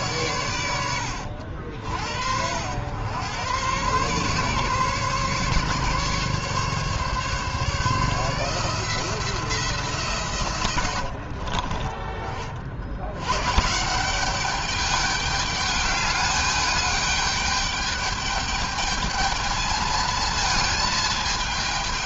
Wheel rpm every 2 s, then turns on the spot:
100, 90, 140, 140, 160, 90, 70, 210, 210, 210, 220.
10-12